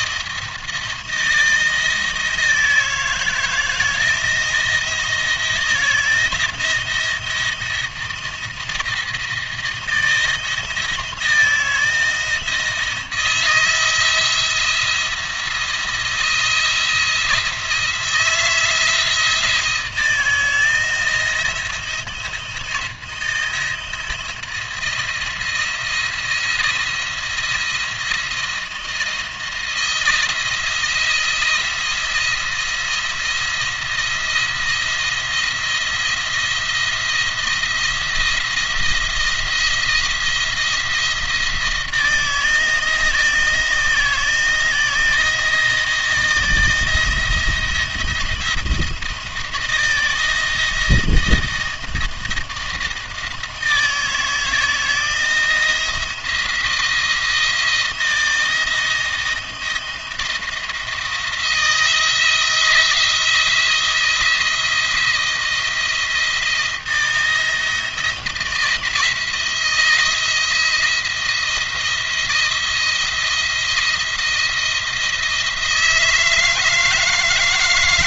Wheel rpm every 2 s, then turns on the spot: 170, 160, 160, 170, 160, 160, 170, 170, 160, 170, 160, 160, 170, 170, 170, 170, 170, 170, 170, 170, 160, 160, 160, 170, 170, 160, 160, 160, 160, 160, 170, 170, 170, 170, 170, 170, 170, 170, 160.
none